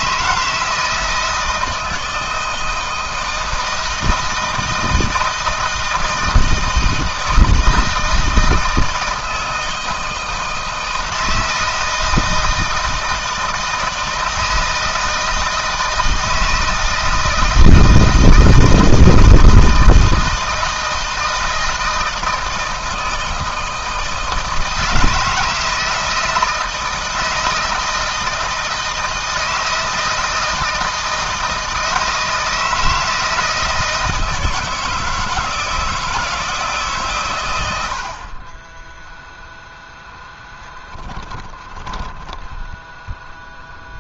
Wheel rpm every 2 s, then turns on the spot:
160, 160, 160, 160, 160, 160, 160, 160, 160, 160, 160, 160, 160, 160, 160, 160, 160, 160, 150, 20, 10, 10.
40-42